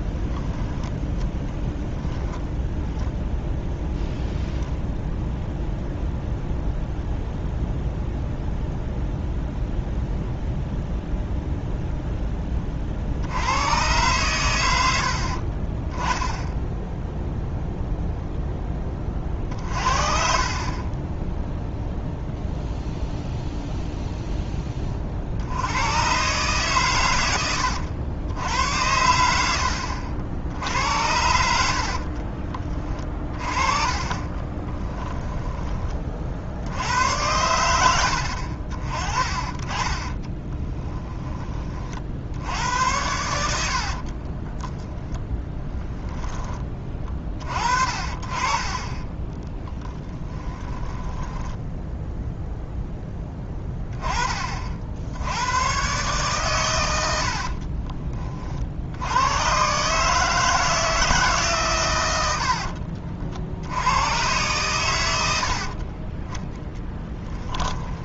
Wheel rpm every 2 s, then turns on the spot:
10, 10, 0, 0, 0, 0, 30, 100, 10, 10, 30, 0, 20, 130, 90, 70, 30, 20, 70, 50, 20, 80, 10, 20, 30, 20, 0, 50, 120, 60, 160, 70, 110, 10.
0-4 34-36 40-42 44-46 50-52